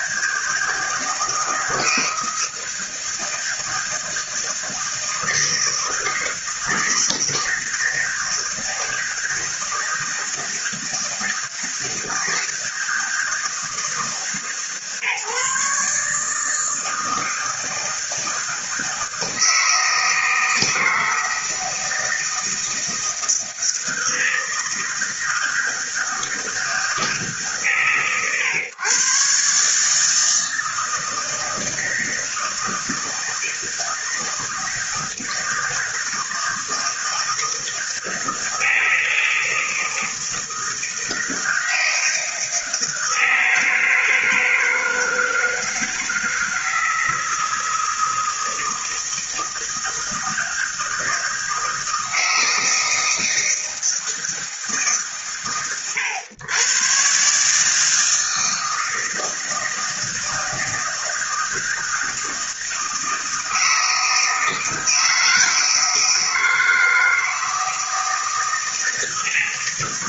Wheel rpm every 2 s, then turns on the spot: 160, 160, 160, 160, 160, 160, 160, 150, 160, 160, 160, 160, 160, 160, 130, 160, 160, 160, 160, 160, 160, 160, 160, 160, 160, 160, 160, 160, 120, 160, 160, 160, 160, 160, 160.
none